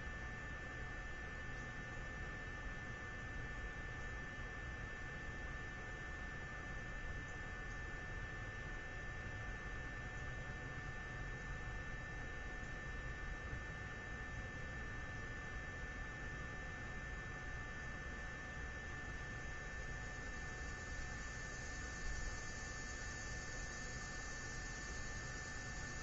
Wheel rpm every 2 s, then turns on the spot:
0, 0, 0, 0, 0, 0, 0, 0, 0, 0, 0, 0, 0.
none